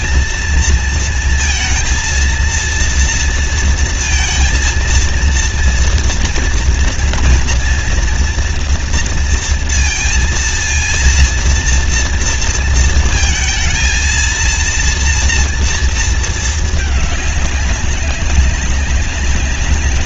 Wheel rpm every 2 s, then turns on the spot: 230, 230, 230, 230, 230, 230, 230, 230, 220, 200.
none